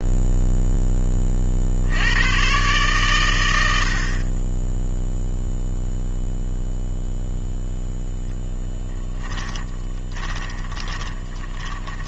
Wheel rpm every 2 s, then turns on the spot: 50, 100, 0, 0, 10, 20.
8-12